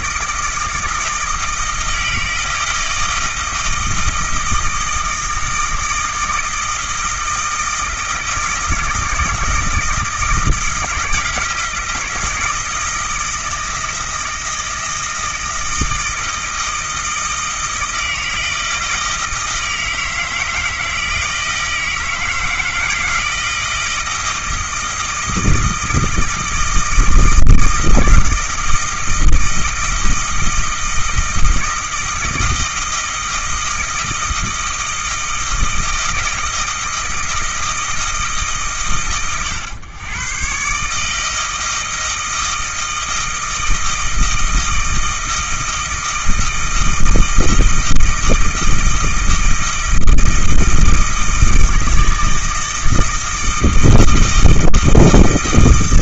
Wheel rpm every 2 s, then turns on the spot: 160, 160, 160, 160, 160, 170, 160, 160, 160, 160, 160, 160, 160, 160, 160, 160, 160, 160, 160, 140, 130, 160, 160, 160, 160, 160, 160, 160.
none